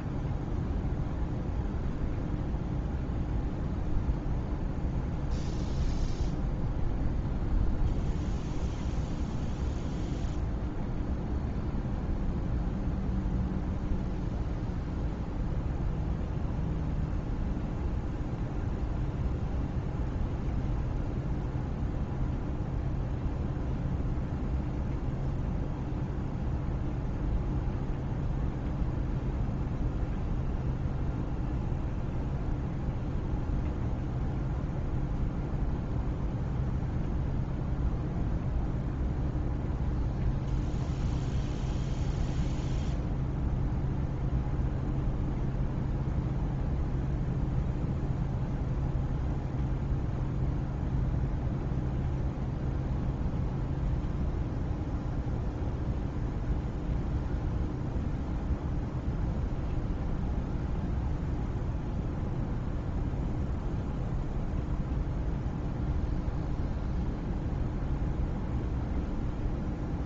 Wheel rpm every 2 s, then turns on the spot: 0, 0, 0, 0, 0, 0, 0, 0, 0, 0, 0, 0, 0, 0, 0, 0, 0, 0, 0, 0, 0, 0, 0, 0, 0, 0, 0, 0, 0, 0, 0, 0, 0, 0, 0.
none